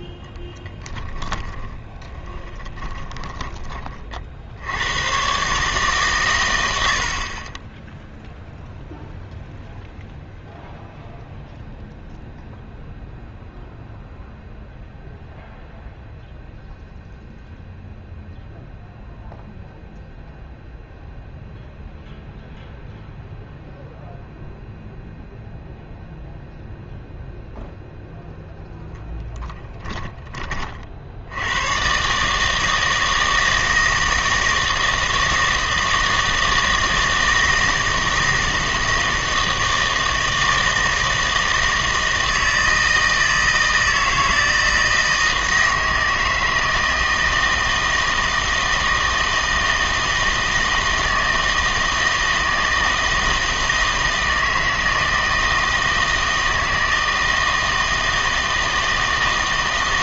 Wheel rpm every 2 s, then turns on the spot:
10, 20, 90, 90, 0, 0, 0, 0, 0, 0, 0, 0, 0, 0, 0, 40, 160, 160, 160, 160, 160, 160, 160, 160, 160, 160, 160, 160, 160, 160.
0-4